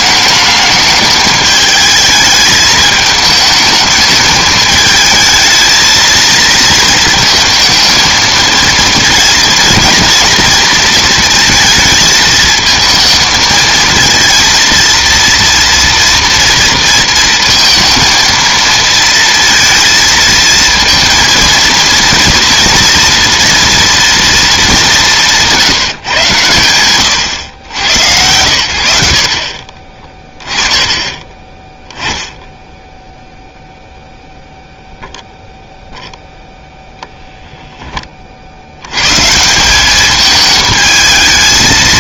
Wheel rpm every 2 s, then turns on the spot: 210, 210, 220, 230, 230, 230, 220, 230, 230, 230, 230, 230, 210, 110, 80, 20, 0, 0, 0, 90, 220.
28-30